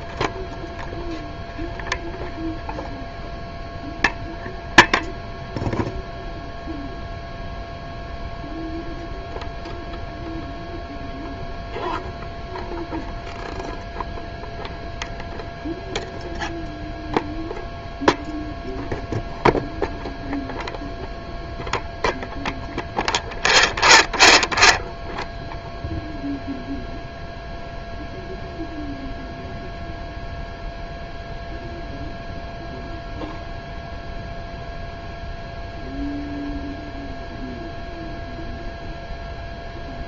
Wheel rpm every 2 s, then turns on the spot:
0, 0, 0, 0, 0, 0, 0, 0, 0, 0, 0, 0, 0, 0, 0, 0, 0, 0, 0, 0.
none